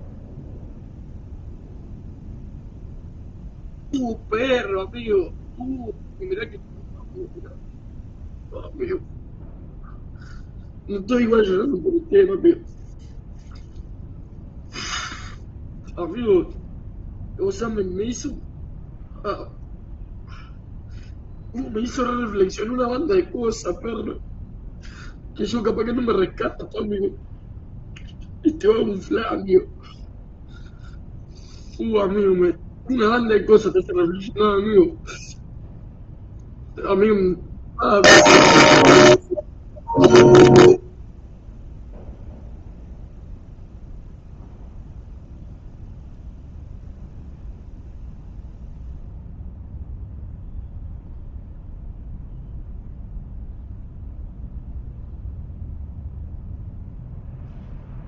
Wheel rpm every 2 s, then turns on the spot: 0, 0, 0, 0, 0, 0, 0, 0, 0, 0, 0, 0, 0, 0, 0, 0, 0, 0, 0, 0, 0, 0, 0, 0, 0, 0, 0, 0, 0.
none